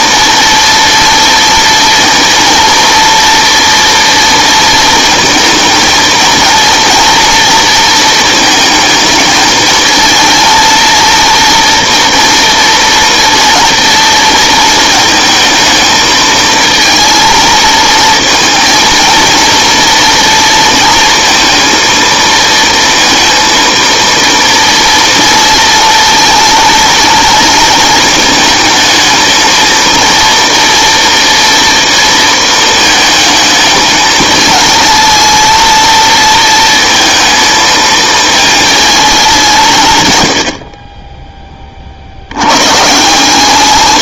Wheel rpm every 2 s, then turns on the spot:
240, 230, 230, 230, 220, 230, 230, 230, 220, 230, 230, 230, 230, 230, 220, 230, 220, 220, 230, 220, 60, 120.
none